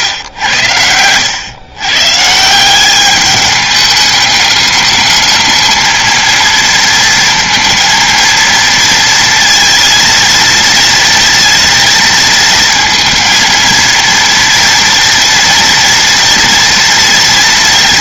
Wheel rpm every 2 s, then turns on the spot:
90, 190, 210, 230, 230, 230, 230, 230, 230.
none